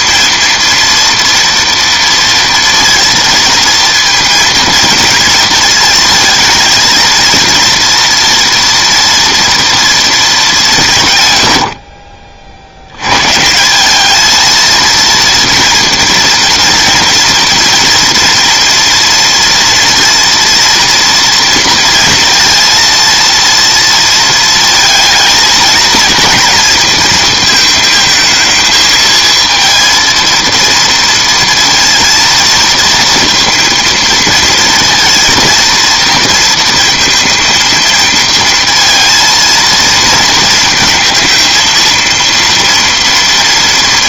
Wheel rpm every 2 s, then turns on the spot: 230, 230, 230, 230, 230, 190, 70, 230, 230, 230, 230, 230, 230, 230, 220, 230, 230, 230, 230, 230, 230, 230.
none